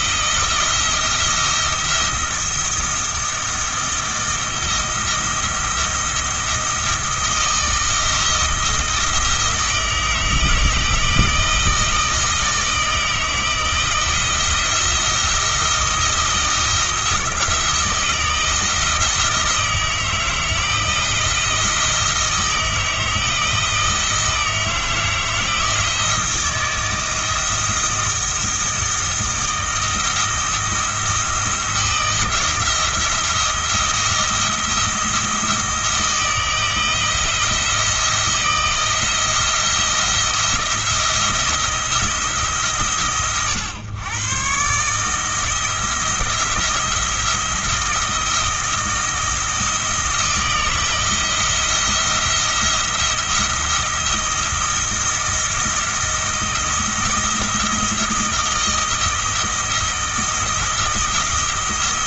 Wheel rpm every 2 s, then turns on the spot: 170, 170, 170, 170, 170, 160, 160, 170, 170, 170, 170, 160, 160, 160, 160, 170, 170, 170, 170, 170, 170, 150, 130, 170, 160, 160, 170, 170, 170, 160, 170.
none